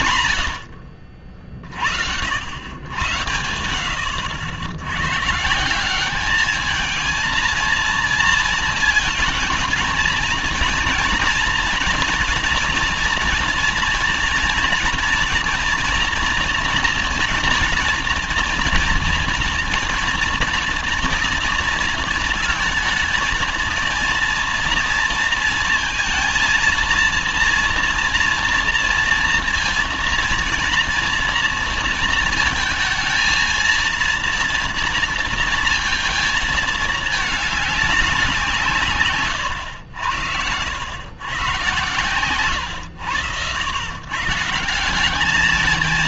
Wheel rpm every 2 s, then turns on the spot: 90, 90, 90, 220, 230, 230, 230, 230, 230, 230, 230, 220, 230, 230, 230, 230, 220, 230, 220, 160, 100, 120, 170.
none